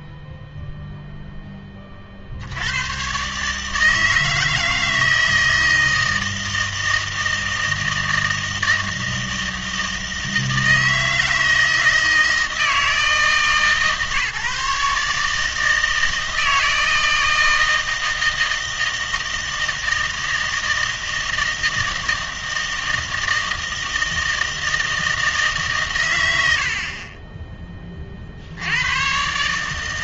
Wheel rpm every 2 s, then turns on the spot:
0, 100, 160, 160, 160, 160, 160, 150, 160, 160, 160, 160, 160, 60, 100.
none